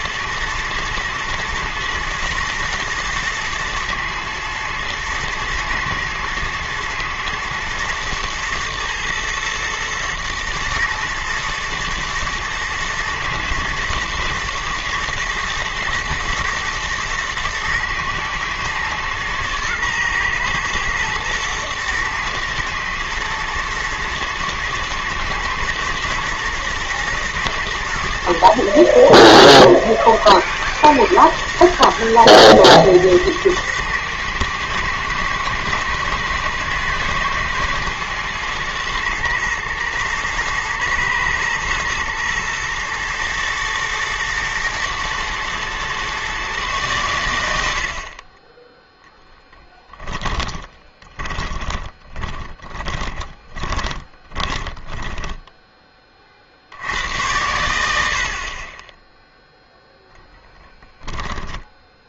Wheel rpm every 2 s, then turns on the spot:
120, 120, 120, 110, 110, 120, 110, 120, 120, 120, 110, 110, 110, 120, 110, 120, 110, 110, 110, 120, 120, 110, 110, 90, 0, 20, 20, 10, 90, 0, 10.
50-56 60-62